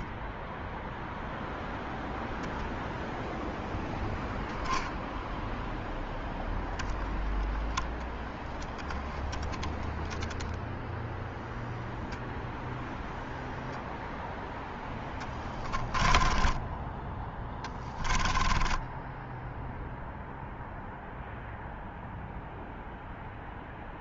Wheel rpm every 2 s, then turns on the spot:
0, 0, 0, 10, 10, 0, 0, 10, 20, 10, 0, 0.
14-16 18-20